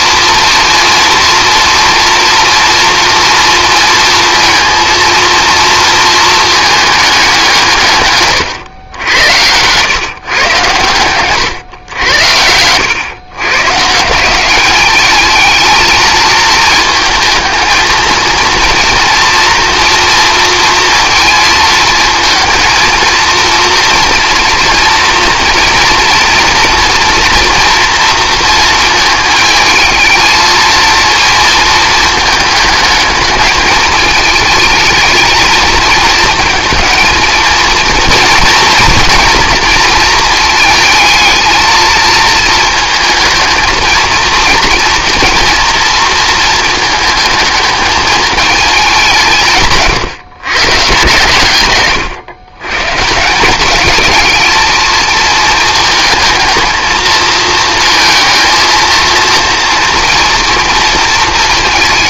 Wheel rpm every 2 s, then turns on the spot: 230, 230, 230, 220, 100, 120, 100, 200, 220, 230, 230, 230, 230, 230, 220, 230, 220, 220, 230, 230, 220, 230, 230, 220, 200, 140, 140, 220, 220, 230, 230.
none